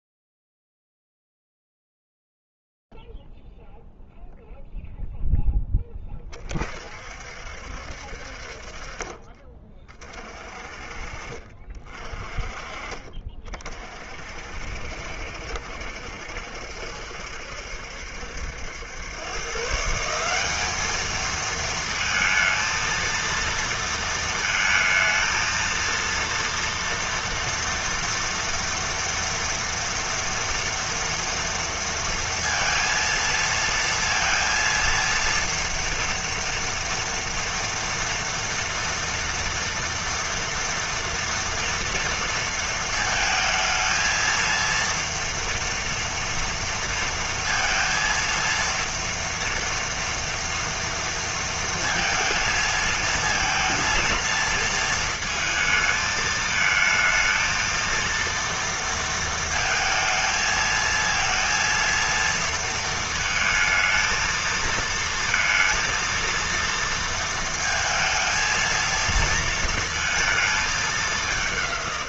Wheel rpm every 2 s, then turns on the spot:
0, 0, 0, 20, 50, 40, 40, 60, 70, 120, 220, 230, 220, 230, 230, 230, 230, 230, 230, 240, 230, 220, 230, 230, 230, 230, 220, 230, 220, 230, 230, 230, 230, 230, 230, 190.
10-12